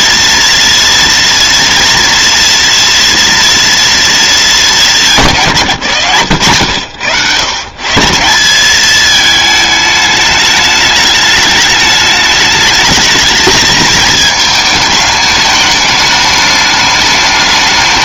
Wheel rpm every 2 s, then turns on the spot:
230, 230, 200, 100, 200, 210, 220, 210, 210.
none